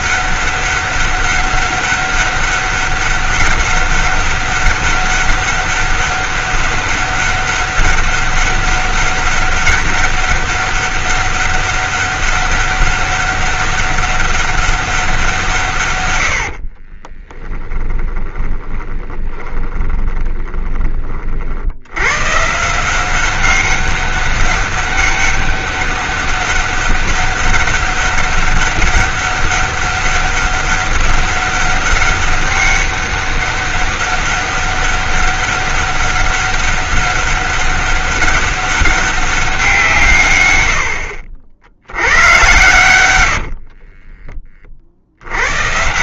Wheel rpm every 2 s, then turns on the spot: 200, 200, 200, 200, 200, 200, 200, 200, 60, 20, 20, 150, 200, 200, 190, 200, 200, 200, 200, 200, 90, 110, 40.
16-22